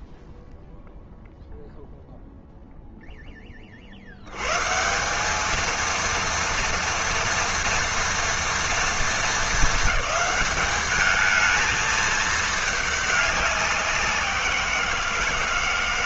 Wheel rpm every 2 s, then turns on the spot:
0, 0, 170, 230, 230, 210, 210, 170.
none